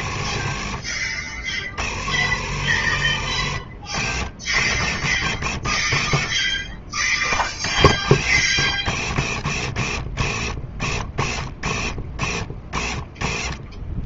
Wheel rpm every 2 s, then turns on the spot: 30, 50, 50, 40, 50, 40, 20.
none